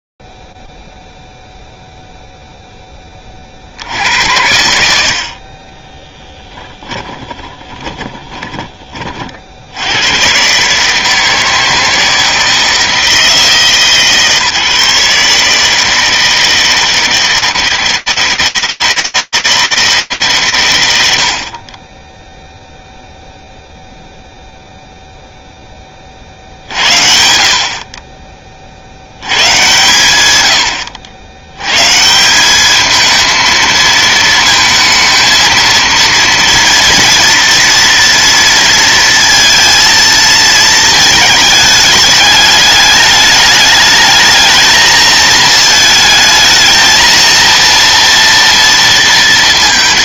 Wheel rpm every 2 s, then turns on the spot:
0, 0, 80, 10, 20, 130, 160, 150, 160, 160, 130, 0, 0, 60, 90, 90, 220, 220, 230, 230, 220, 210, 220, 220, 230.
6-10